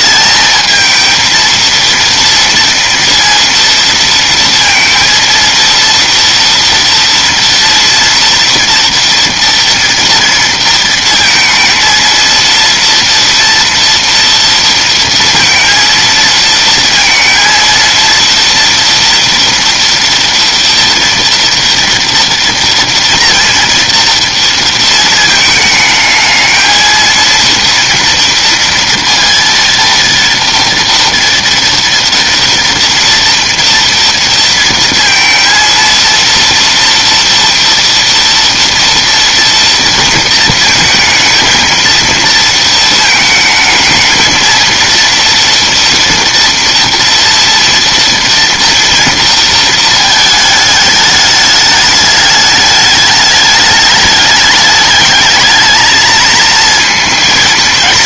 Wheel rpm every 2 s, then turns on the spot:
220, 230, 230, 230, 230, 230, 230, 230, 230, 230, 230, 230, 230, 220, 230, 230, 230, 230, 230, 230, 220, 230, 230, 240, 230, 210, 210, 210, 230.
none